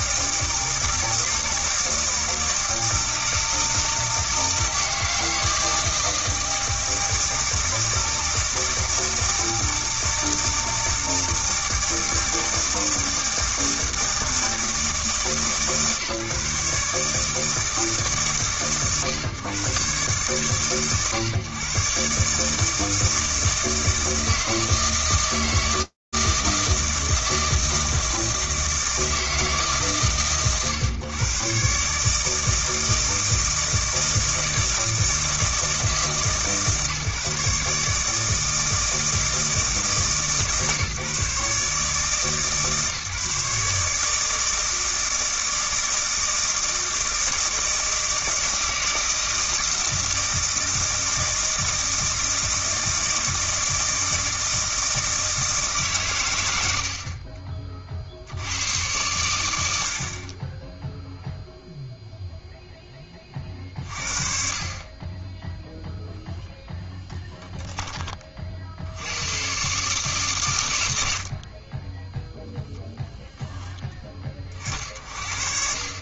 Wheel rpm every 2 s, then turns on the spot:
160, 160, 160, 160, 160, 160, 160, 160, 140, 120, 120, 160, 160, 160, 160, 110, 160, 160, 140, 160, 150, 150, 160, 160, 160, 160, 160, 160, 80, 110, 10, 0, 50, 10, 60, 110, 0, 70.
none